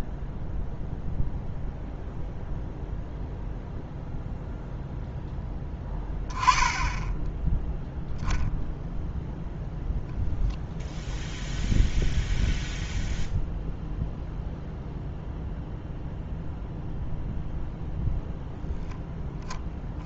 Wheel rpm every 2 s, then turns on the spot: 0, 0, 0, 10, 0, 0, 0, 0, 0, 0.
none